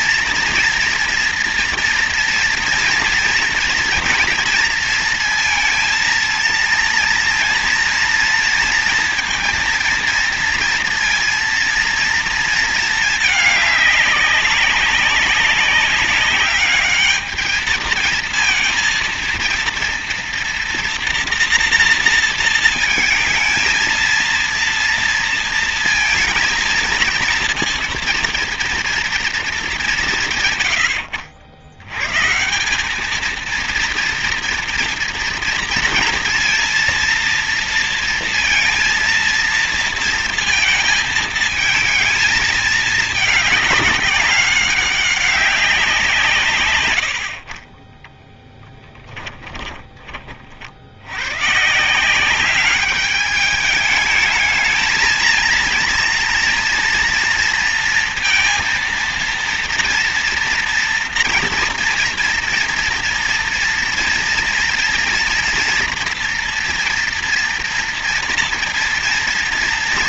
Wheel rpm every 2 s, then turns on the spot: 230, 230, 230, 230, 230, 230, 220, 200, 200, 230, 230, 230, 230, 230, 230, 100, 200, 230, 230, 230, 220, 210, 200, 110, 10, 50, 200, 220, 230, 230, 230, 230, 240, 240, 230.
none